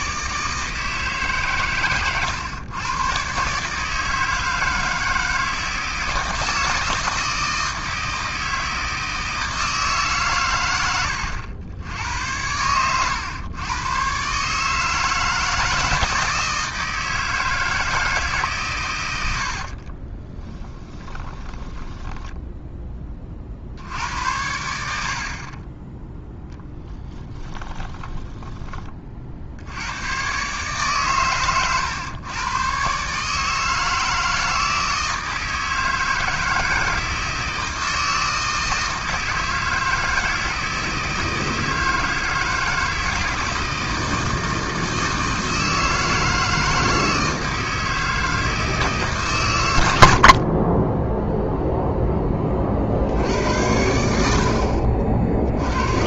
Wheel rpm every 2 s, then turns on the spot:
160, 110, 160, 160, 160, 100, 100, 150, 160, 130, 10, 10, 70, 20, 30, 140, 130, 160, 160, 160, 160, 160, 160, 160, 160, 20, 40, 50.
20-22 26-28 50-52